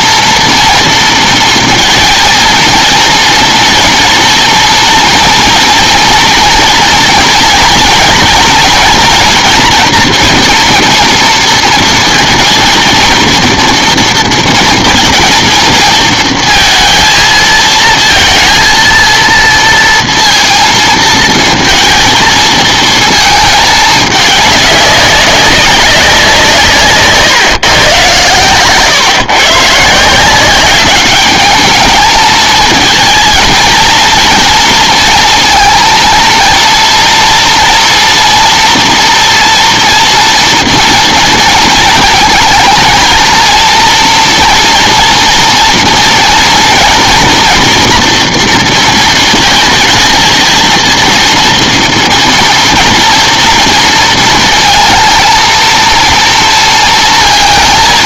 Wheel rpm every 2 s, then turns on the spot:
230, 230, 230, 230, 240, 230, 230, 220, 230, 230, 230, 220, 210, 160, 120, 200, 220, 230, 230, 230, 230, 220, 230, 240, 230, 230, 230, 230, 230.
none